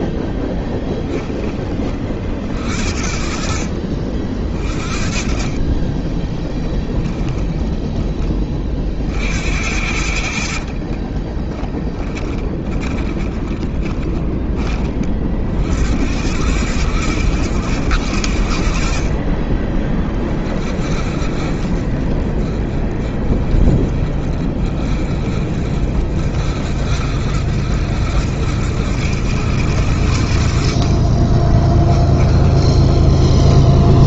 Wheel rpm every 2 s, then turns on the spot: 20, 60, 40, 10, 60, 30, 20, 40, 80, 40, 40, 30, 40, 60, 80, 30, 10.
4-8 10-14 30-34